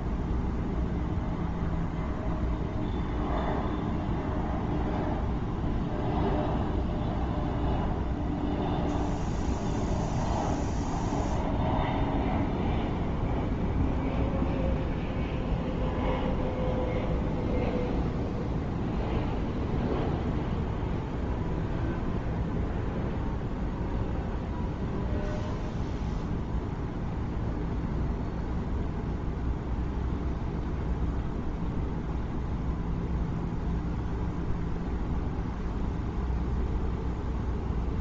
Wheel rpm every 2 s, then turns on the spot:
0, 0, 0, 0, 0, 0, 0, 0, 0, 0, 0, 0, 0, 0, 0, 0, 0, 0, 0.
none